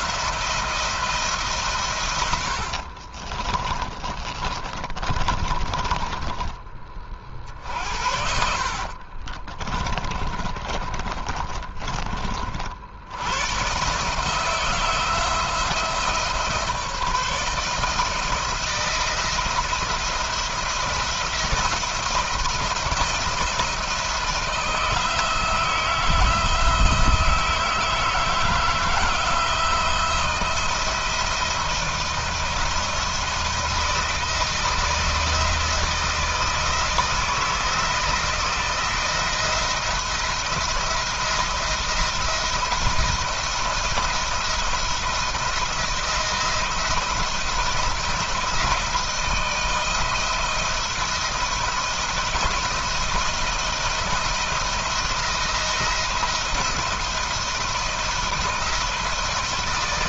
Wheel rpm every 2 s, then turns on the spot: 160, 40, 30, 50, 40, 20, 70, 170, 150, 170, 170, 170, 160, 160, 160, 160, 160, 160, 160, 170, 170, 170, 170, 170, 160, 170, 170, 170, 170, 160.
2-6 8-12